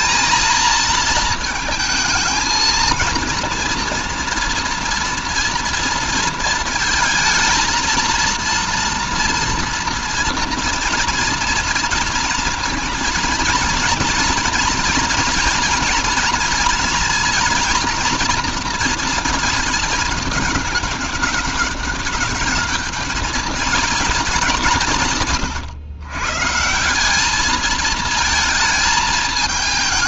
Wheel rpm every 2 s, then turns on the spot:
230, 230, 230, 230, 230, 230, 230, 240, 230, 230, 210, 210, 200, 160, 220.
none